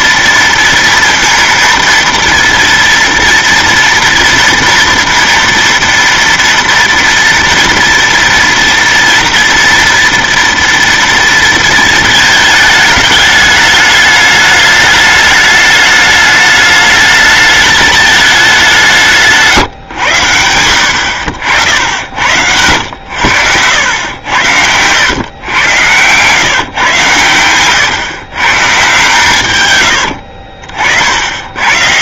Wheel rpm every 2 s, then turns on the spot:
230, 230, 230, 230, 230, 230, 220, 210, 210, 190, 80, 90, 90, 130, 130, 60.
30-32